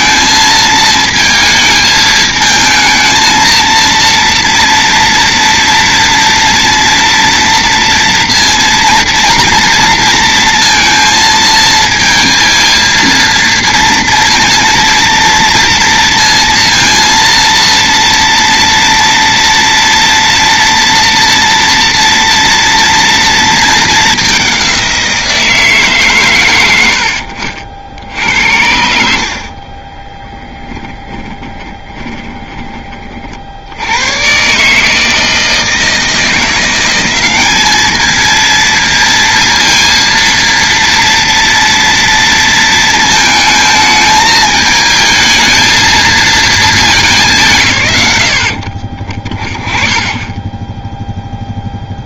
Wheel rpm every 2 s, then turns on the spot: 220, 220, 230, 230, 230, 230, 230, 230, 230, 230, 230, 230, 190, 90, 70, 10, 20, 150, 180, 230, 230, 220, 220, 210, 50, 10.
30-32